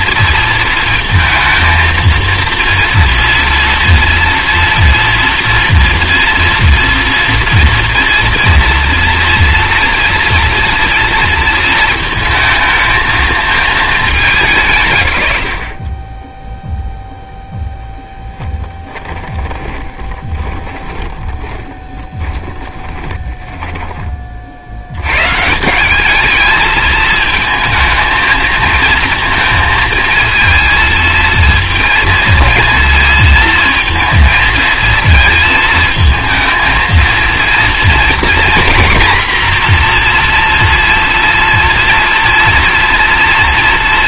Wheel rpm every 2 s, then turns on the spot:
230, 230, 230, 230, 240, 230, 220, 120, 0, 10, 20, 10, 110, 220, 230, 230, 230, 220, 230, 230, 230, 230.
18-24